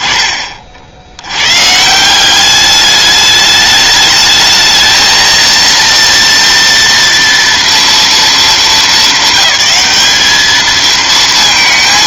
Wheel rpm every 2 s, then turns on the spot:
20, 180, 210, 230, 220, 210.
none